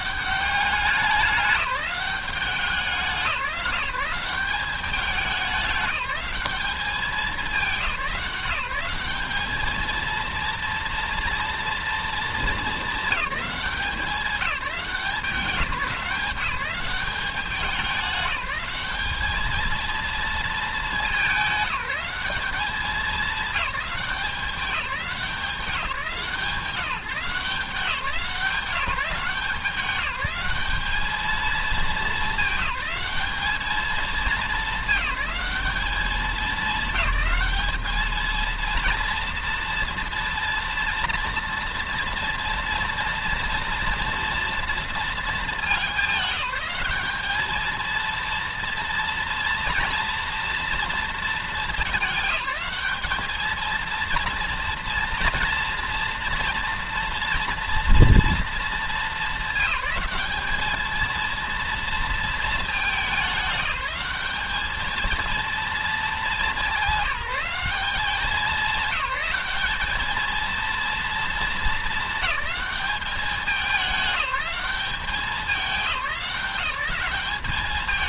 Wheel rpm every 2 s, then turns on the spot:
190, 180, 190, 210, 190, 230, 200, 200, 190, 210, 210, 190, 180, 170, 180, 200, 210, 210, 210, 230, 230, 230, 220, 200, 230, 230, 210, 230, 230, 220, 220, 220, 220, 200, 210, 230, 210, 200, 190.
none